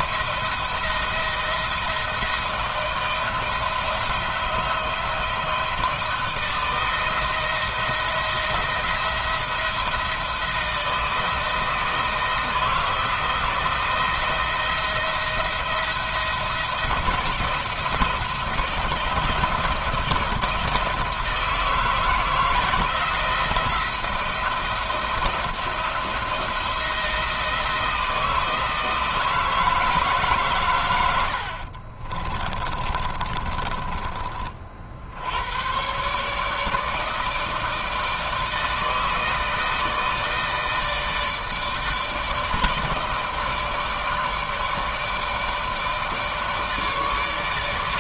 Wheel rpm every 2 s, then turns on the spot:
170, 170, 170, 170, 170, 160, 170, 170, 170, 160, 170, 170, 170, 170, 160, 130, 30, 40, 150, 160, 160, 160, 160, 160.
32-34